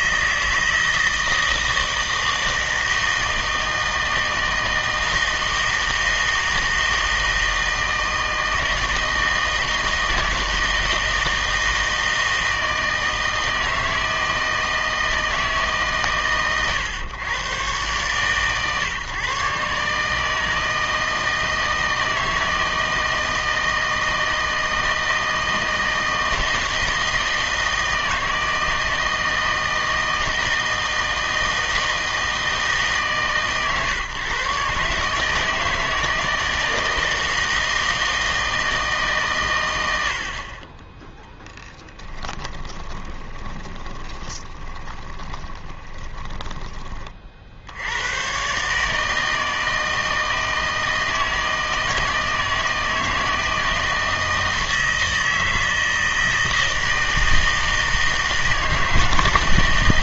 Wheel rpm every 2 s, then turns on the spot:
160, 160, 160, 160, 160, 160, 160, 160, 120, 130, 160, 160, 160, 160, 160, 160, 160, 140, 160, 160, 30, 20, 10, 20, 140, 160, 160, 160, 160, 160.
42-46